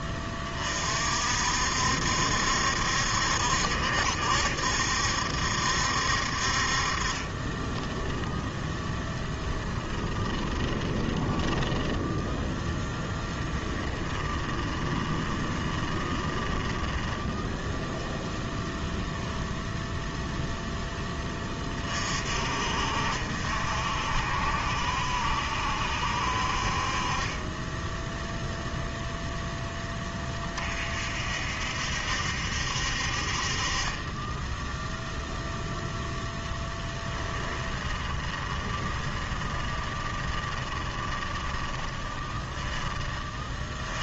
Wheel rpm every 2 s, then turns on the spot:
30, 70, 70, 60, 10, 20, 0, 20, 10, 0, 0, 50, 60, 50, 0, 40, 60, 10, 0, 20, 20, 20.
8-12 14-18 38-44